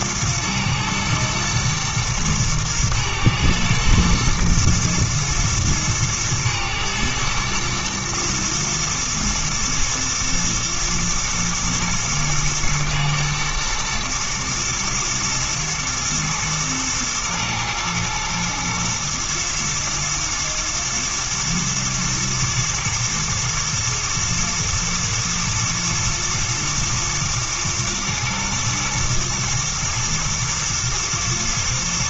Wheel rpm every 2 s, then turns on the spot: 110, 110, 120, 110, 110, 120, 110, 120, 110, 110, 120, 120, 110, 120, 120, 120.
none